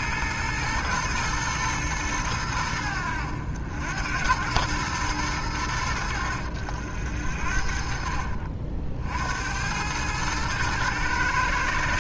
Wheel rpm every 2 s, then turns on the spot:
110, 90, 110, 80, 60, 110.
none